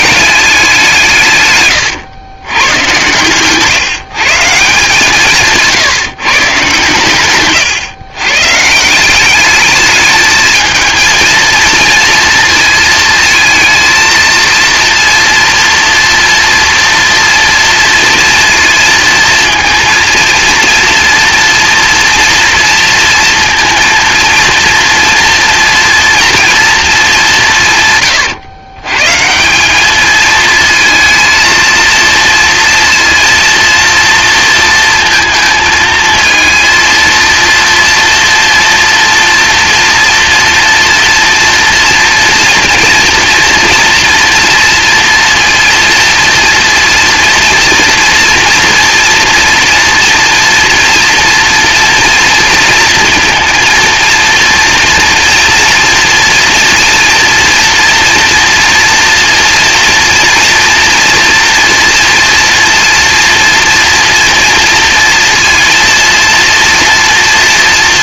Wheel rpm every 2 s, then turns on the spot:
190, 110, 150, 140, 160, 220, 230, 230, 230, 230, 230, 240, 230, 230, 130, 230, 230, 230, 230, 230, 240, 230, 230, 230, 230, 240, 230, 230, 230, 230, 230, 230, 230, 230.
none